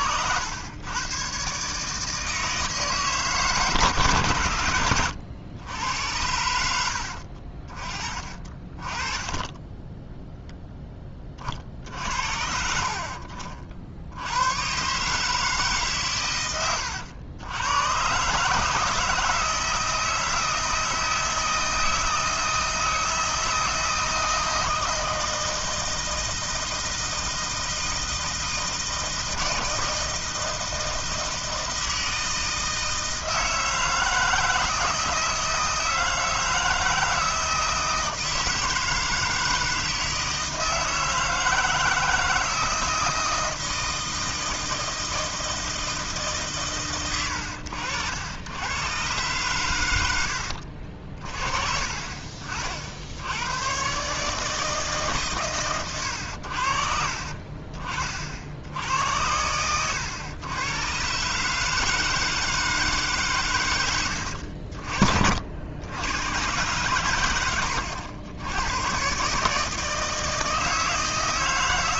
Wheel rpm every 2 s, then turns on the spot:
100, 160, 100, 80, 30, 10, 60, 130, 90, 150, 160, 160, 160, 160, 160, 160, 160, 160, 160, 160, 160, 160, 160, 130, 110, 70, 60, 150, 60, 70, 110, 160, 60, 130, 100, 160.
none